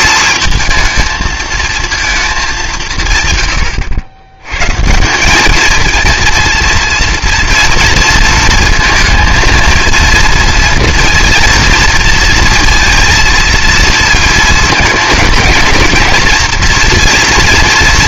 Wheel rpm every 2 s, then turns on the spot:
230, 190, 130, 230, 230, 230, 230, 220, 240.
none